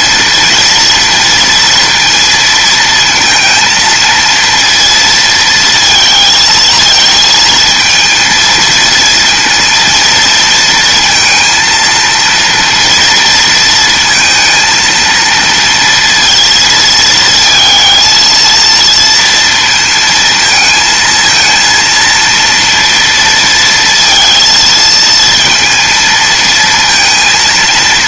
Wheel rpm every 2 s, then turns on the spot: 230, 230, 230, 220, 230, 230, 230, 230, 230, 230, 220, 230, 230, 230.
none